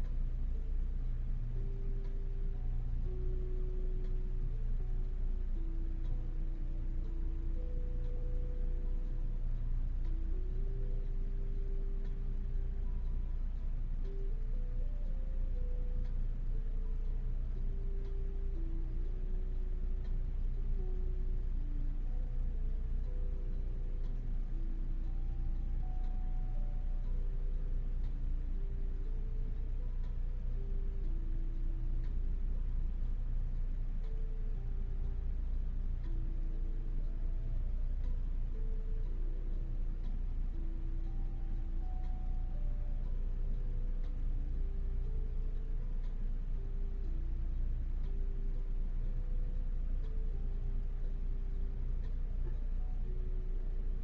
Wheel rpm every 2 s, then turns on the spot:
0, 0, 0, 0, 0, 0, 0, 0, 0, 0, 0, 0, 0, 0, 0, 0, 0, 0, 0, 0, 0, 0, 0, 0, 0, 0, 0.
none